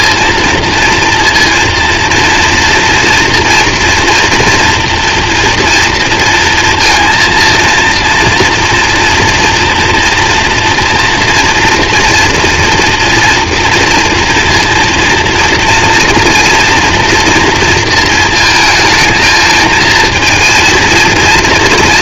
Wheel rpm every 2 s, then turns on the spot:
230, 230, 230, 230, 230, 240, 240, 230, 230, 220, 230.
none